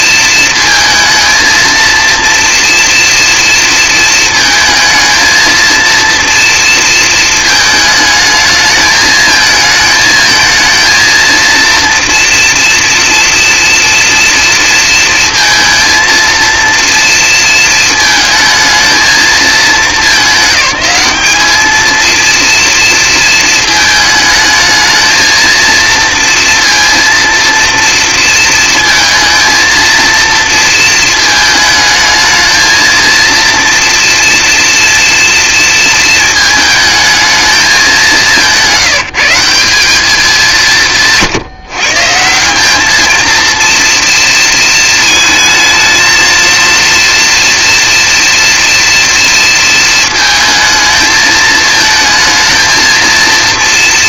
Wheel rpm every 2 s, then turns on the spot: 220, 230, 220, 230, 220, 230, 230, 230, 230, 220, 190, 230, 220, 230, 230, 230, 230, 240, 220, 180, 170, 210, 230, 230, 240, 230, 230.
none